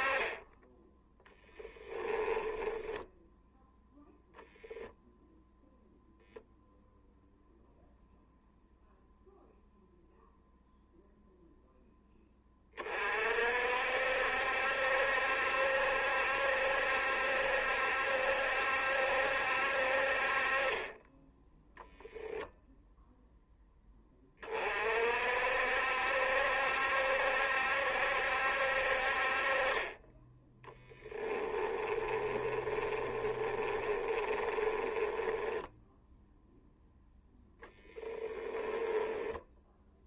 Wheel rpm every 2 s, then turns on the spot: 20, 10, 0, 0, 0, 0, 40, 70, 70, 70, 30, 0, 50, 70, 60, 10, 20, 20, 0, 20.
0-4 30-36 38-40